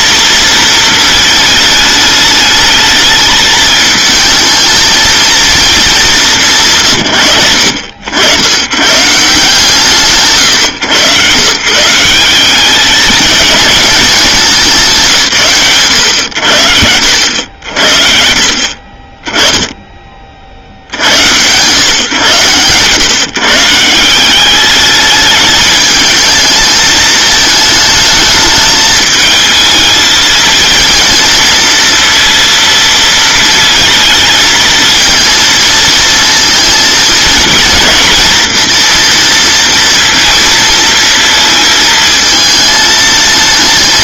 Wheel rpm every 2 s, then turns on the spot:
220, 210, 220, 160, 90, 130, 190, 180, 80, 50, 60, 120, 200, 220, 210, 220, 230, 220, 230, 230, 230, 220.
none